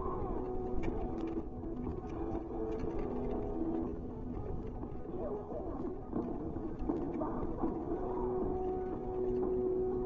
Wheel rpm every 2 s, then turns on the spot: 0, 0, 0, 0, 0.
none